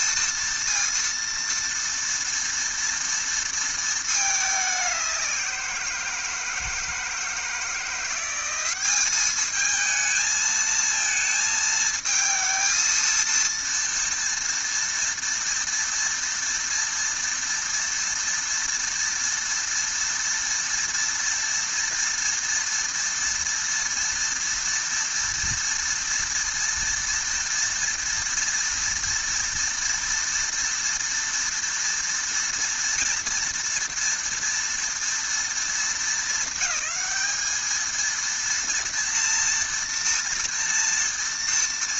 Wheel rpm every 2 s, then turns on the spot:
230, 230, 190, 160, 210, 220, 230, 230, 230, 230, 230, 230, 230, 230, 230, 230, 230, 230, 200, 230, 230.
none